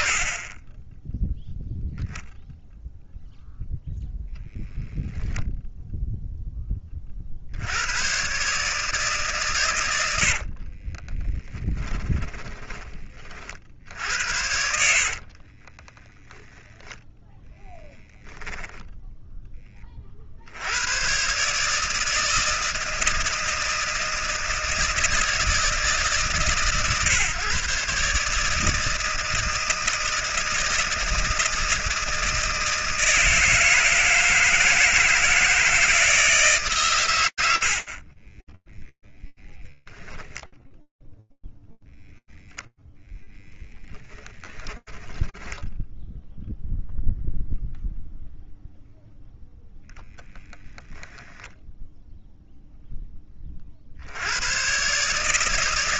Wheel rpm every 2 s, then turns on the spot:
0, 0, 0, 100, 100, 10, 50, 30, 10, 20, 150, 160, 150, 130, 160, 160, 160, 160, 60, 0, 0, 0, 20, 0, 0, 0, 20, 140.
10-12 14-16 44-46